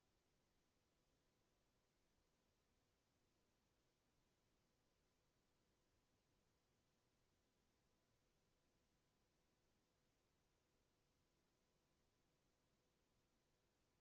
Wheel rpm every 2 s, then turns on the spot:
0, 0, 0, 0, 0, 0, 0.
none